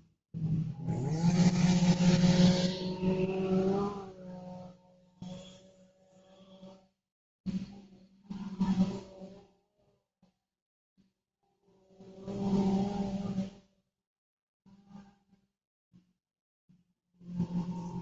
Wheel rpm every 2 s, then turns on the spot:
0, 0, 0, 0, 0, 0, 0, 0, 0.
none